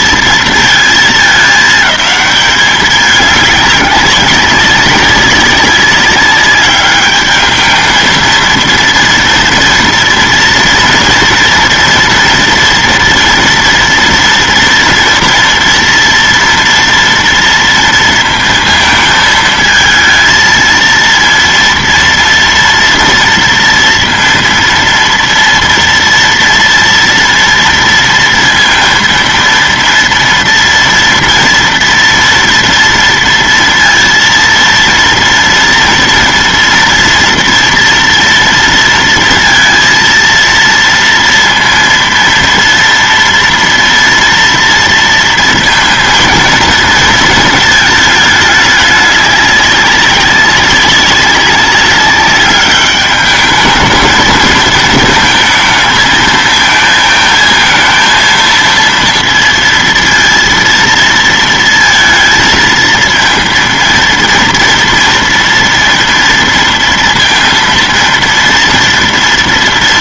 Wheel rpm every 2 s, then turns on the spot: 220, 210, 190, 200, 230, 240, 240, 230, 230, 230, 230, 230, 230, 230, 230, 230, 230, 230, 230, 230, 230, 230, 230, 230, 210, 190, 200, 220, 220, 230, 230, 230, 230, 230, 230.
none